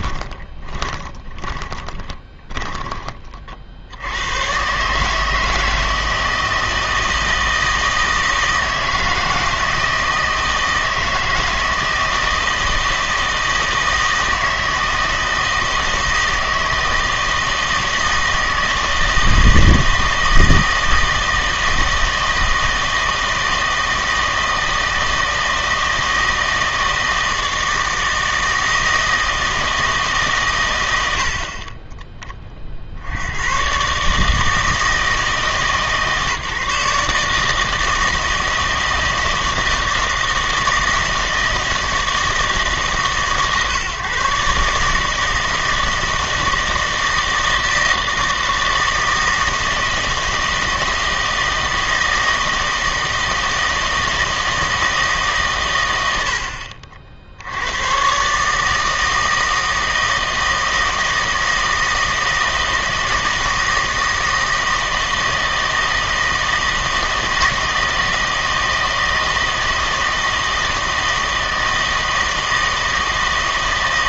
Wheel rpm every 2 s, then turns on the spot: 20, 10, 140, 160, 160, 160, 160, 160, 160, 160, 160, 160, 170, 160, 160, 100, 50, 160, 150, 160, 160, 150, 150, 160, 160, 160, 160, 160, 60, 150, 160, 160, 160, 160, 160, 160, 160.
0-2